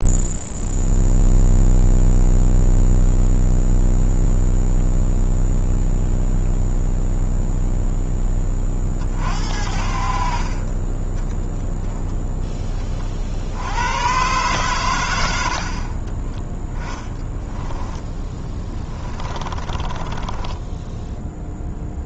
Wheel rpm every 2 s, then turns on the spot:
0, 0, 0, 0, 40, 20, 30, 110, 10, 10, 0.
16-20